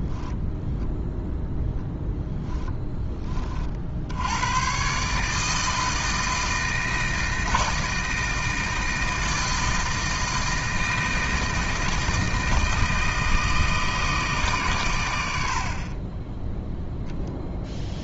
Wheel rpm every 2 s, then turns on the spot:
0, 10, 120, 160, 160, 160, 160, 130, 0.
none